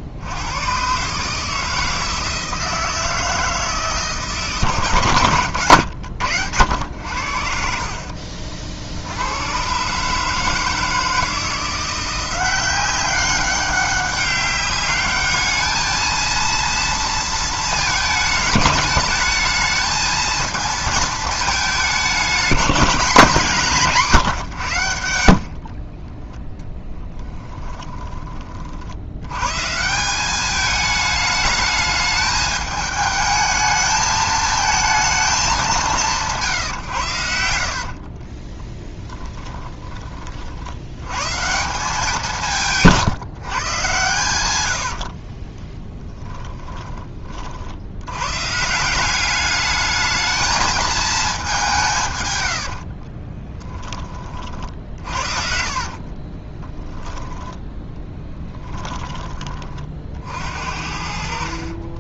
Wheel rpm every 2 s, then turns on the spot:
120, 160, 140, 90, 60, 160, 190, 200, 230, 210, 230, 210, 120, 10, 50, 210, 210, 220, 140, 10, 70, 160, 90, 10, 150, 220, 70, 50, 20, 10, 50.
26-28 38-40 44-48 52-58